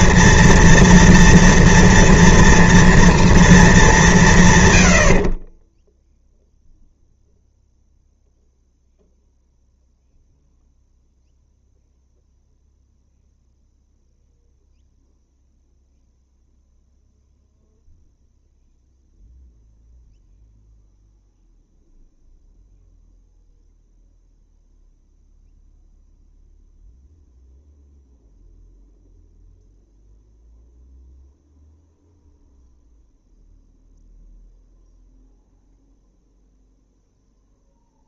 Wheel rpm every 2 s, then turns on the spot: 230, 230, 120, 0, 0, 0, 0, 0, 0, 0, 0, 0, 0, 0, 0, 0, 0, 0, 0.
none